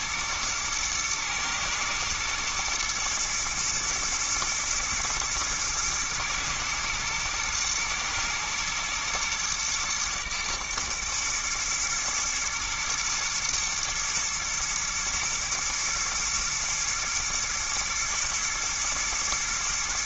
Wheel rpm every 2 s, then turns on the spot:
110, 120, 110, 110, 120, 110, 110, 110, 110, 110.
none